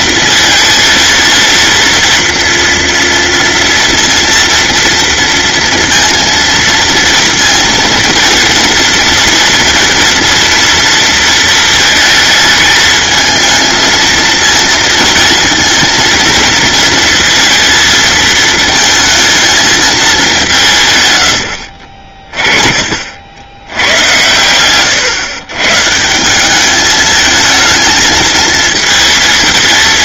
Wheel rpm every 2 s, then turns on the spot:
230, 230, 230, 230, 230, 230, 220, 230, 230, 220, 150, 40, 120, 210, 230.
none